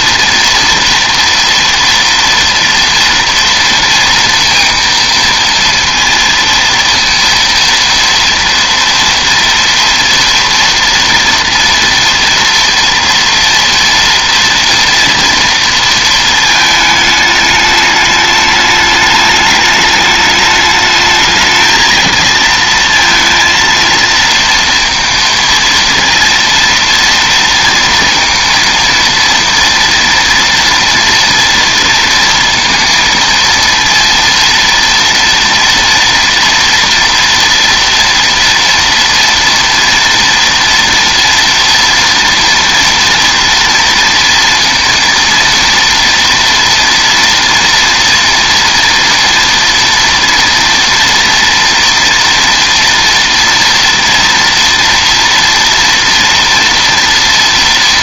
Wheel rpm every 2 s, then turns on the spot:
230, 230, 230, 230, 230, 230, 230, 240, 220, 210, 210, 230, 230, 230, 230, 230, 230, 230, 230, 230, 230, 230, 230, 230, 230, 230, 230, 230, 230.
none